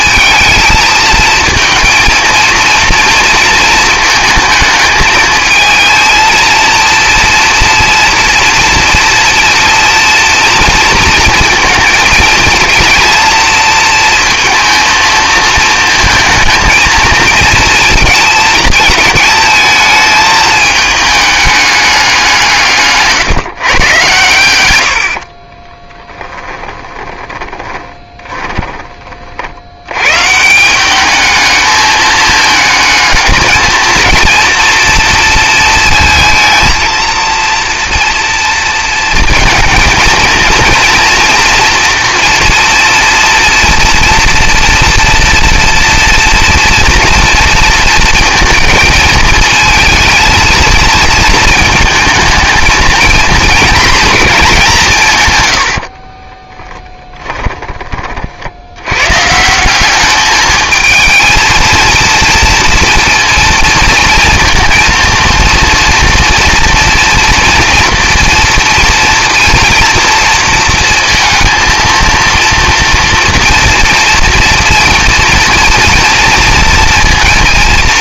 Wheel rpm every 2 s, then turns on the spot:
220, 220, 220, 230, 230, 230, 220, 220, 220, 220, 220, 150, 90, 20, 20, 190, 220, 230, 220, 230, 230, 230, 240, 230, 230, 230, 220, 200, 10, 90, 220, 230, 230, 230, 230, 230, 230, 230, 230.
26-28 56-58